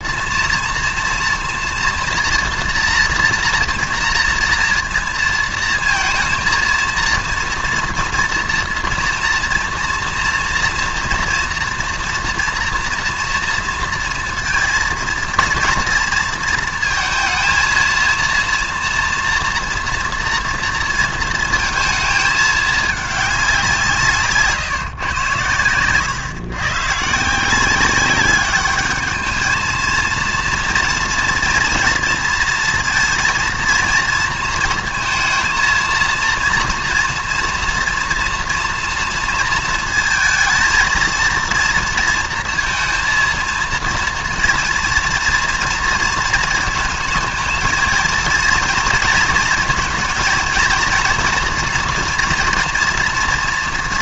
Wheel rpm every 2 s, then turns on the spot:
230, 240, 230, 230, 230, 230, 240, 230, 230, 230, 230, 220, 140, 120, 210, 230, 230, 220, 230, 230, 230, 230, 230, 220, 230, 220, 230.
none